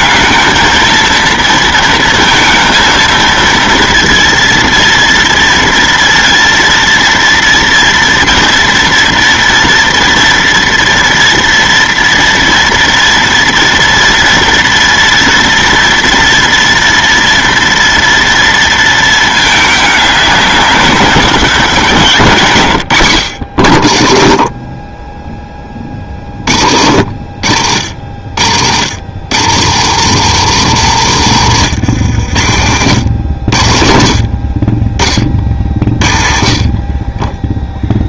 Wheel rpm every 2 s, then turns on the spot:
220, 230, 230, 230, 230, 230, 230, 240, 230, 230, 190, 120, 30, 60, 90, 160, 90, 40, 40.
32-34